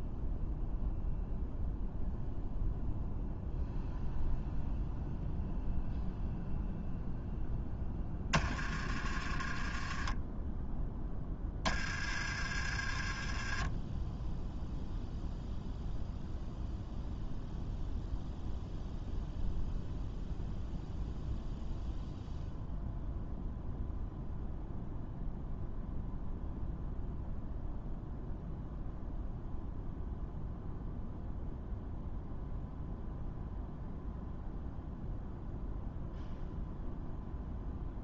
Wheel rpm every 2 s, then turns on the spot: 0, 0, 0, 0, 20, 10, 20, 0, 0, 0, 0, 0, 0, 0, 0, 0, 0, 0, 0.
none